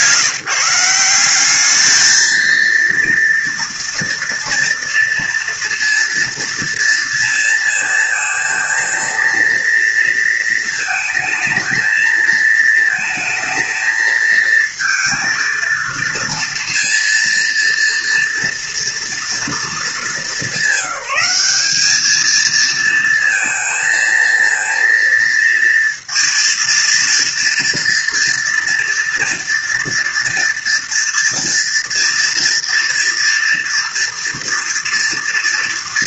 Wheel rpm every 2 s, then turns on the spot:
180, 230, 230, 230, 230, 220, 220, 230, 230, 230, 190, 230, 230, 230, 230, 230, 230, 230.
none